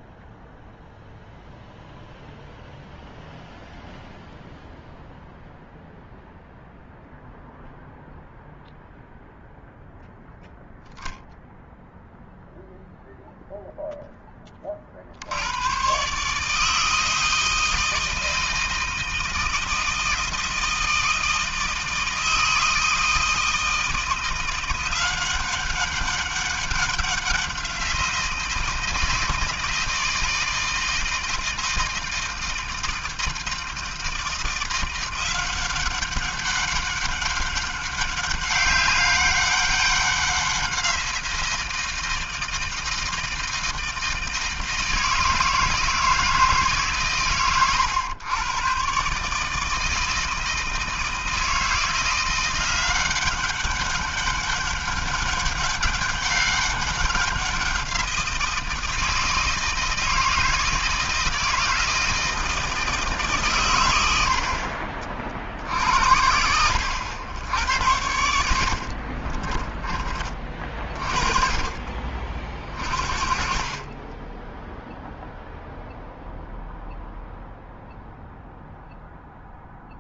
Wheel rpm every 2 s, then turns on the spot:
0, 0, 0, 0, 0, 10, 0, 70, 160, 160, 160, 160, 180, 190, 160, 160, 160, 180, 200, 200, 180, 160, 160, 130, 140, 160, 190, 200, 190, 170, 160, 150, 50, 90, 40, 30, 40, 0, 0, 0.
68-70